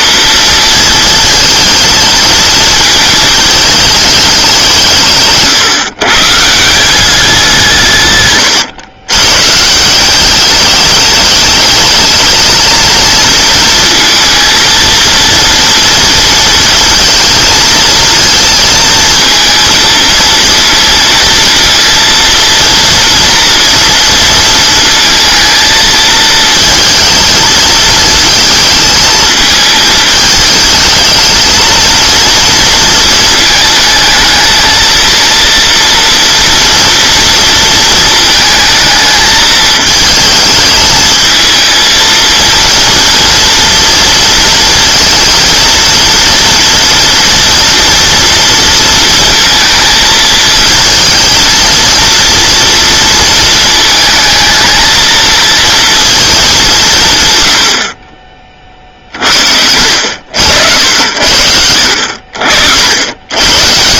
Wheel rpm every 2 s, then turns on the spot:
230, 220, 190, 160, 110, 200, 220, 220, 230, 230, 230, 230, 230, 230, 220, 220, 230, 220, 230, 220, 220, 230, 230, 230, 230, 230, 230, 220, 190, 40, 80, 70.
none